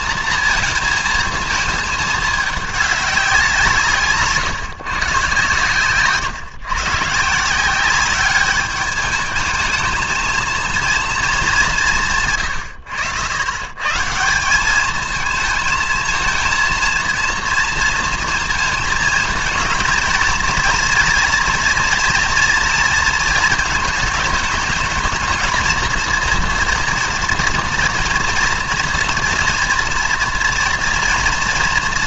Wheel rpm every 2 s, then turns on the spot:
220, 210, 150, 120, 200, 230, 120, 190, 230, 230, 230, 230, 210, 230, 230, 230.
none